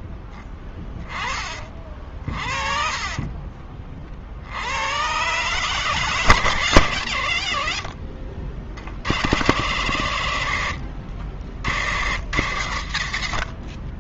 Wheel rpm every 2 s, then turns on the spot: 20, 30, 70, 130, 50, 70, 60.
none